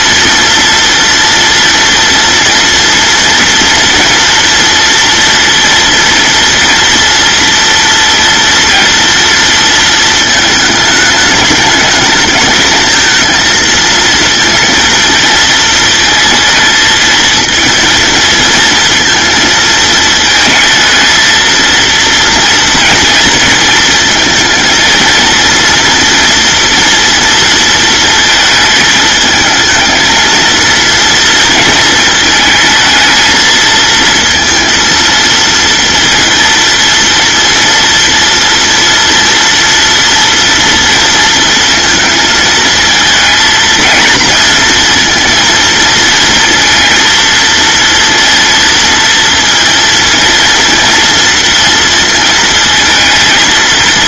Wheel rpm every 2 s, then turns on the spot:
230, 230, 230, 240, 230, 210, 220, 230, 220, 230, 220, 230, 230, 230, 220, 230, 220, 230, 230, 230, 230, 230, 230, 230, 230, 230, 220.
none